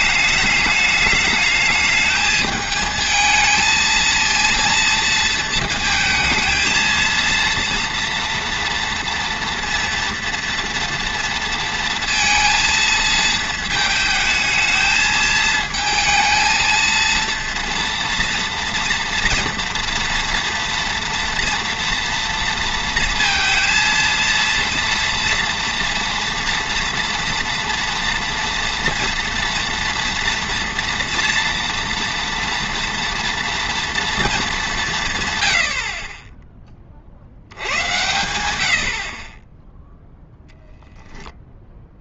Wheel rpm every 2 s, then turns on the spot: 210, 220, 230, 230, 230, 230, 230, 220, 230, 240, 230, 230, 230, 230, 230, 230, 230, 200, 20, 80, 0.
none